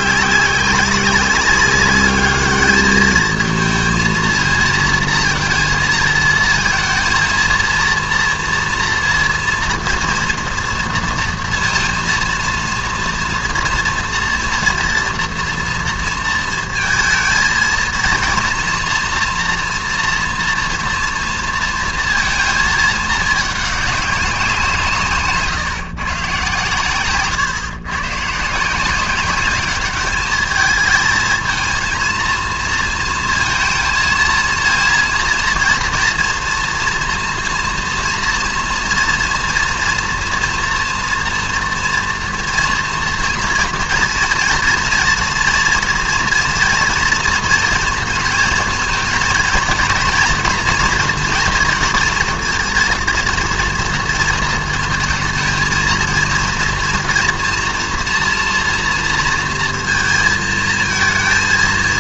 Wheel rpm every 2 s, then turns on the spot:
200, 210, 230, 230, 230, 230, 230, 240, 230, 230, 230, 230, 180, 130, 160, 220, 230, 230, 230, 230, 240, 240, 230, 230, 230, 230, 230, 230, 230, 230, 230.
none